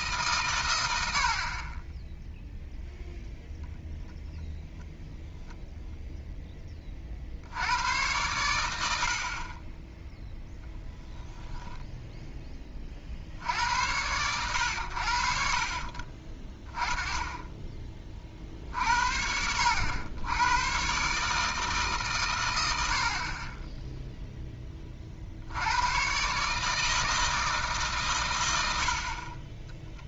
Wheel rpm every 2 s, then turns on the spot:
110, 0, 0, 20, 100, 10, 30, 100, 20, 50, 120, 100, 20, 150, 90.
none